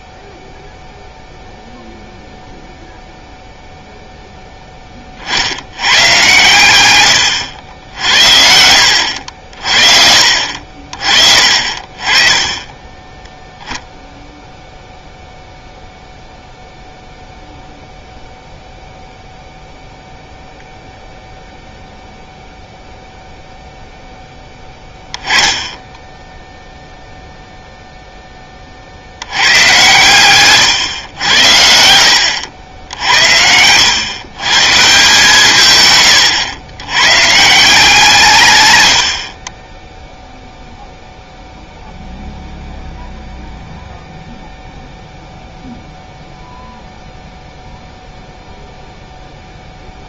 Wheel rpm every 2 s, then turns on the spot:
0, 0, 10, 120, 70, 50, 10, 0, 0, 0, 0, 0, 10, 0, 20, 120, 70, 150, 110, 110, 0, 0, 0, 0, 0.
12-14